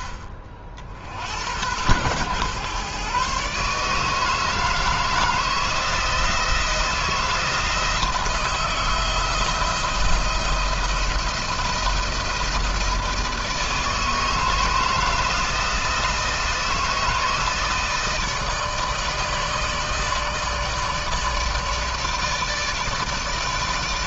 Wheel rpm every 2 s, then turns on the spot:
50, 130, 160, 160, 160, 170, 160, 160, 160, 160, 160, 150.
none